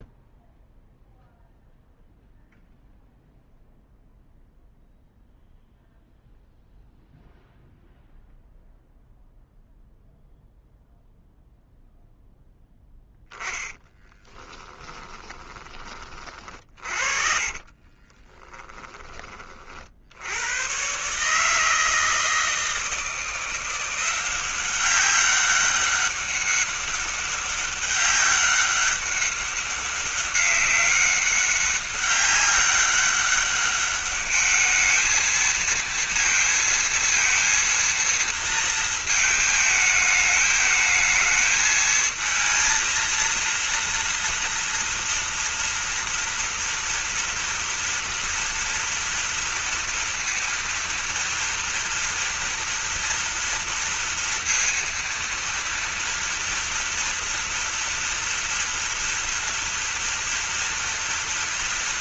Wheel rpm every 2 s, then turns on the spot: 0, 0, 0, 0, 0, 0, 0, 20, 40, 20, 130, 160, 190, 200, 200, 200, 200, 220, 230, 220, 210, 230, 230, 230, 240, 240, 230, 230, 230, 230, 230.
14-18